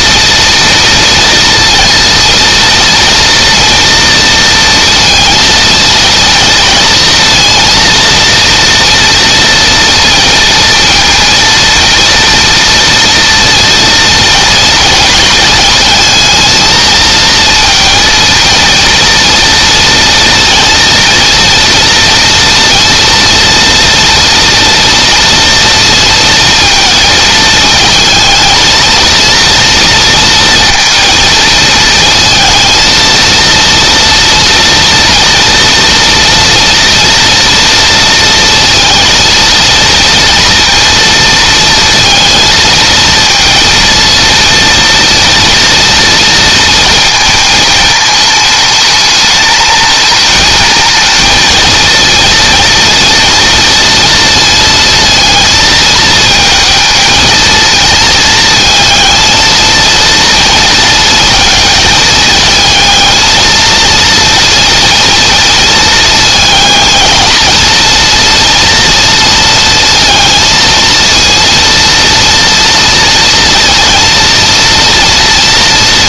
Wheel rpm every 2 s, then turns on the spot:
240, 230, 230, 230, 230, 230, 230, 230, 220, 230, 240, 230, 230, 230, 230, 230, 230, 240, 230, 230, 230, 230, 230, 230, 210, 220, 230, 230, 220, 220, 230, 220, 230, 230, 230, 230, 230, 230.
none